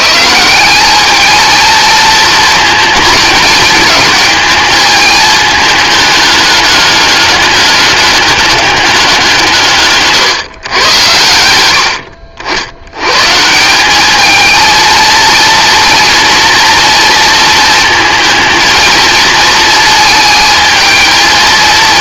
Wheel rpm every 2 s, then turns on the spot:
210, 220, 210, 210, 190, 110, 110, 230, 240, 230, 220.
none